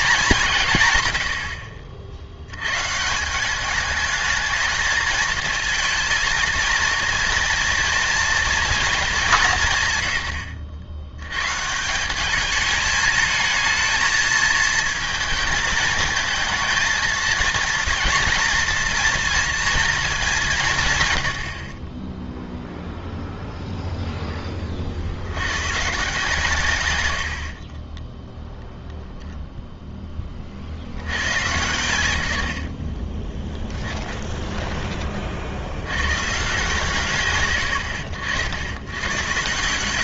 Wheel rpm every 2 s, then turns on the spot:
160, 110, 220, 230, 230, 80, 210, 220, 220, 230, 180, 0, 30, 130, 0, 80, 70, 20, 140, 90.
32-34